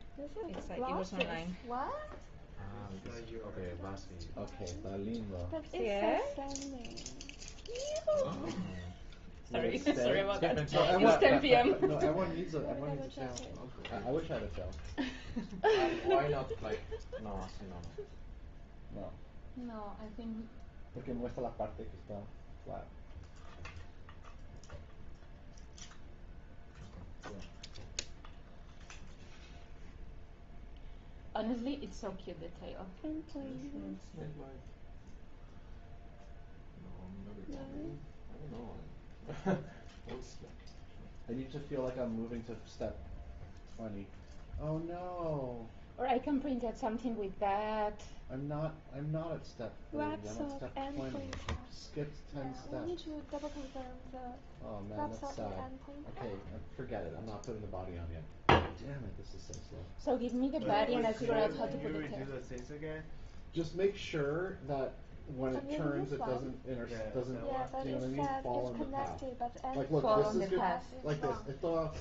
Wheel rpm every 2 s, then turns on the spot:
0, 0, 0, 0, 0, 0, 0, 0, 0, 0, 0, 0, 0, 0, 0, 0, 0, 0, 0, 0, 0, 0, 0, 0, 0, 0, 0, 0, 0, 0, 0, 0, 0, 0, 0, 0.
none